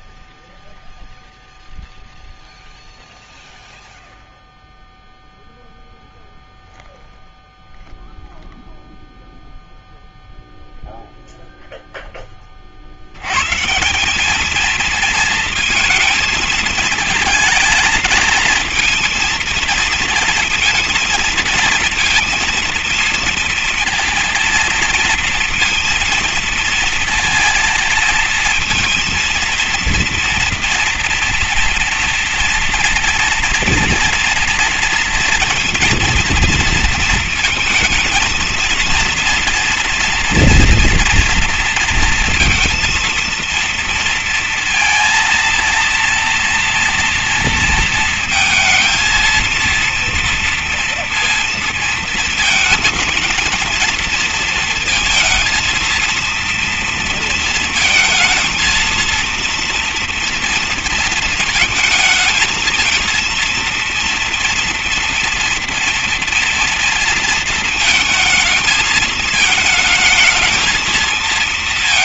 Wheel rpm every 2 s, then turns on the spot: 0, 0, 0, 0, 0, 0, 30, 220, 230, 230, 230, 230, 230, 230, 220, 230, 230, 230, 230, 230, 240, 230, 230, 230, 220, 230, 230, 230, 230, 230, 230, 220, 230, 230, 220, 220.
none